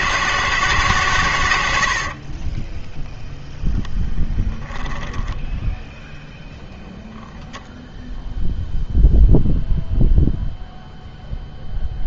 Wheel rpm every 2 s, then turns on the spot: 150, 10, 10, 0, 0, 0.
2-6